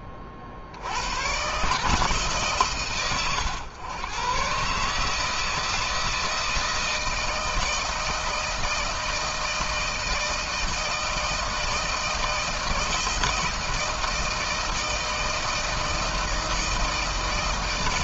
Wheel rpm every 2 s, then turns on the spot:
70, 140, 140, 160, 160, 160, 160, 160, 160.
none